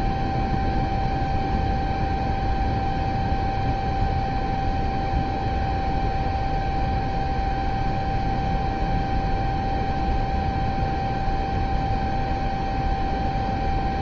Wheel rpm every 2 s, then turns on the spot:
0, 0, 0, 0, 0, 0, 0.
none